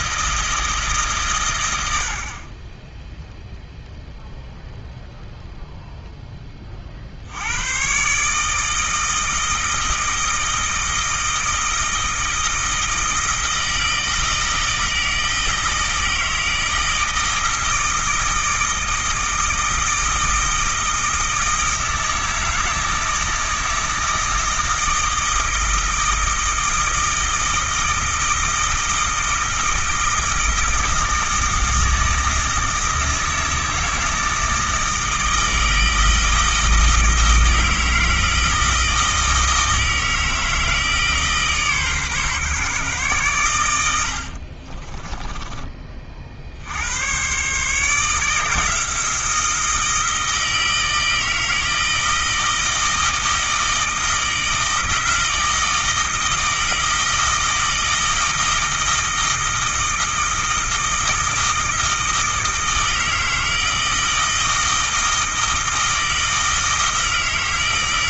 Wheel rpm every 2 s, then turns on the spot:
150, 10, 0, 30, 160, 160, 160, 160, 160, 160, 160, 160, 160, 160, 160, 160, 160, 160, 160, 160, 160, 130, 30, 80, 160, 160, 160, 160, 160, 160, 160, 160, 160, 160.
44-46